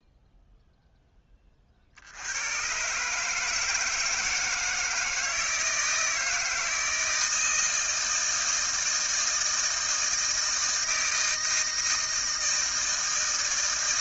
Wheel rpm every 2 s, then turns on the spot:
0, 100, 160, 160, 160, 160, 160.
none